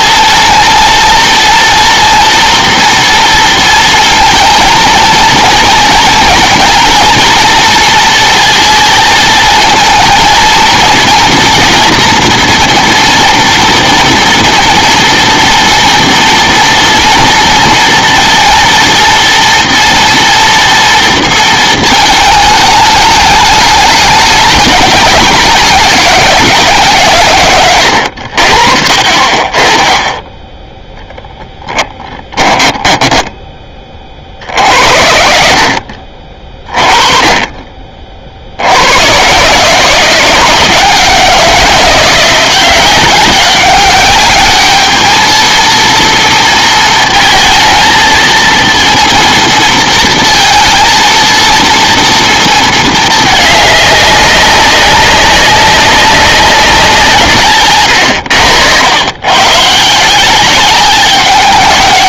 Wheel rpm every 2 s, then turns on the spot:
230, 240, 230, 230, 230, 230, 230, 230, 230, 230, 230, 210, 210, 160, 50, 10, 10, 70, 30, 80, 170, 180, 210, 230, 230, 230, 220, 190, 180, 100, 190.
32-34